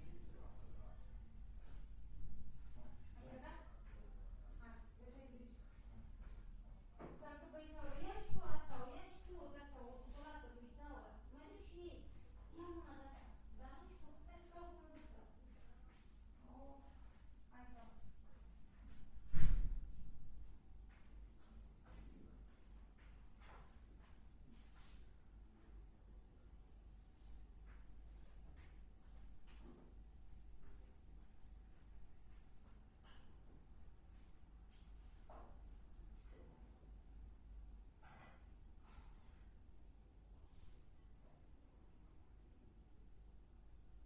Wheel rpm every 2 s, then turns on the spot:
0, 0, 0, 0, 0, 0, 0, 0, 0, 0, 0, 0, 0, 0, 0, 0, 0, 0, 0, 0, 0, 0.
none